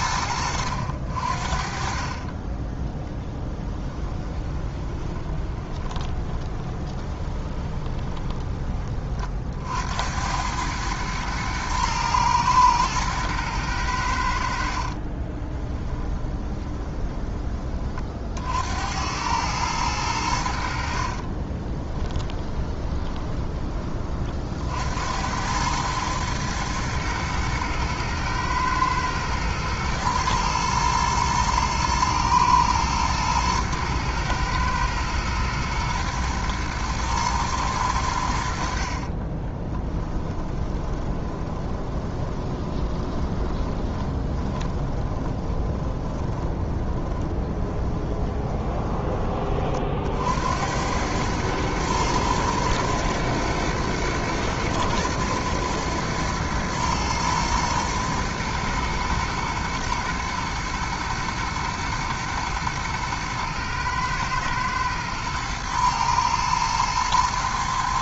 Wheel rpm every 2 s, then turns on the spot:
70, 20, 20, 20, 30, 110, 110, 60, 20, 80, 60, 20, 70, 110, 110, 110, 110, 110, 110, 60, 20, 20, 20, 20, 20, 90, 110, 110, 110, 110, 110, 110, 110, 110.
2-8 14-18 20-24 40-48